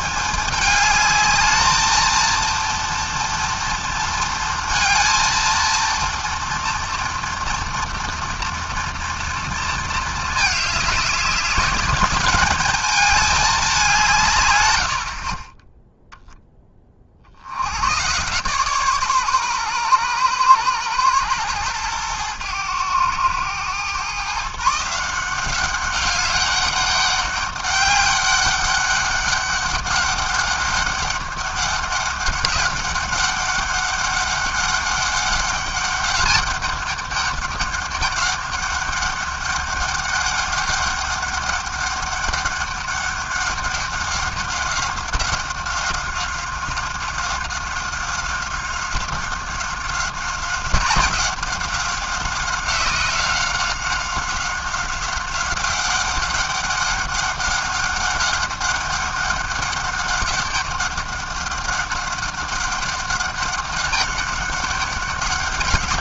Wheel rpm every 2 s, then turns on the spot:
220, 230, 230, 230, 230, 200, 210, 30, 70, 130, 110, 110, 180, 200, 200, 200, 200, 200, 200, 200, 200, 200, 190, 190, 190, 180, 190, 190, 200, 190, 190, 200, 200.
none